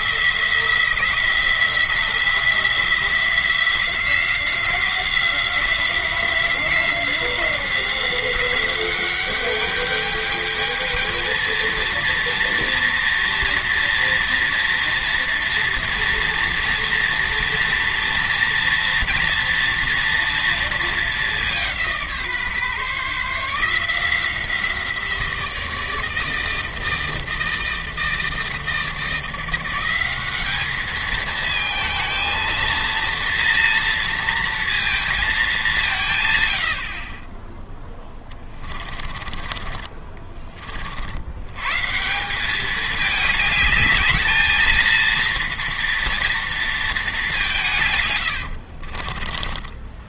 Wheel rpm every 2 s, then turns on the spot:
170, 180, 180, 180, 190, 220, 230, 240, 230, 230, 220, 150, 170, 160, 160, 210, 230, 230, 60, 20, 60, 210, 230, 220, 40.
38-40 48-50